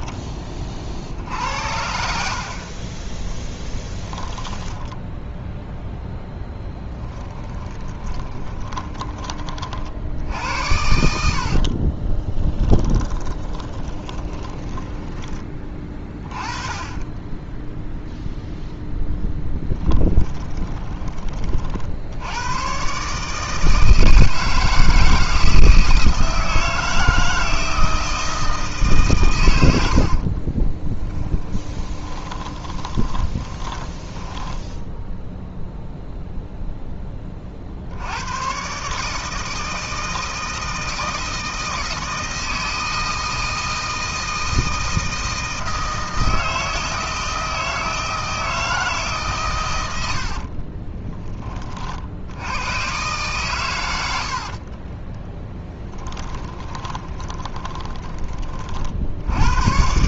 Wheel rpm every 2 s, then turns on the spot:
40, 40, 10, 10, 20, 80, 10, 20, 20, 0, 20, 120, 160, 160, 150, 20, 20, 10, 10, 140, 160, 160, 160, 160, 160, 30, 120, 30, 20, 50.
4-16 20-22 30-36 50-52 54-58